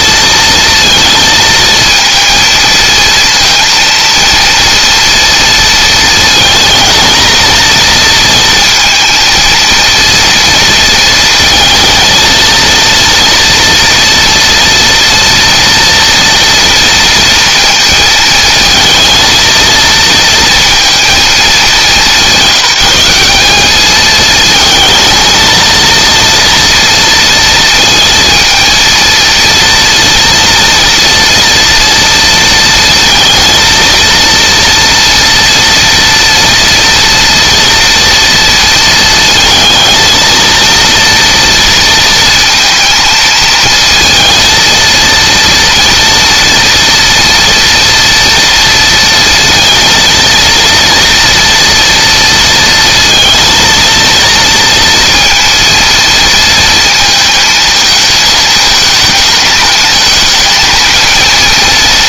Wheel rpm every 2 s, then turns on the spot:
230, 230, 230, 220, 230, 230, 230, 230, 230, 220, 230, 190, 220, 230, 230, 230, 230, 230, 230, 230, 230, 230, 230, 240, 230, 230, 230, 230, 230, 220, 230.
none